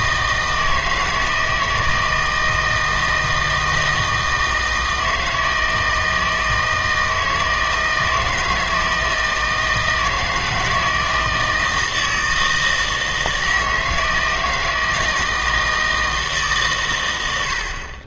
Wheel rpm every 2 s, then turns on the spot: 160, 160, 160, 160, 160, 160, 160, 160, 140.
none